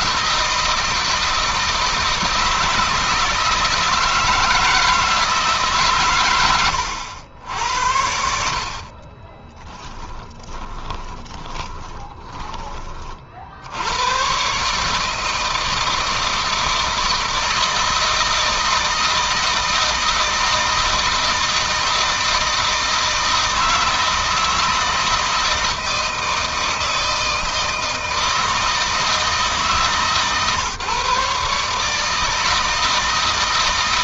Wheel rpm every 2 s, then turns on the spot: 160, 160, 160, 90, 40, 20, 40, 150, 160, 160, 160, 160, 160, 160, 160, 140, 160.
8-12